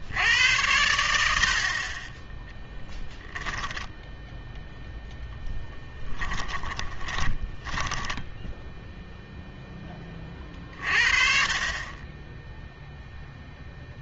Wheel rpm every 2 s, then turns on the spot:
90, 10, 0, 20, 0, 40, 0.
6-8